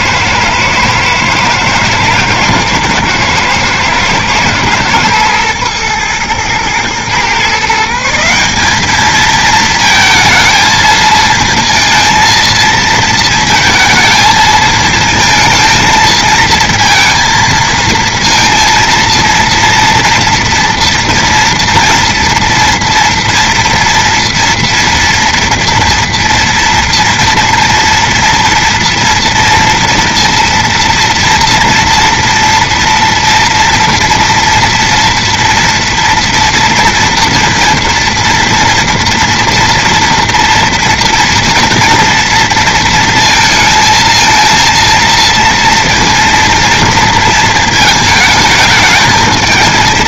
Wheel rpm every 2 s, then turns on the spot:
110, 110, 110, 120, 200, 220, 230, 220, 230, 230, 230, 230, 230, 230, 230, 230, 230, 230, 230, 230, 230, 230, 230, 230, 220.
none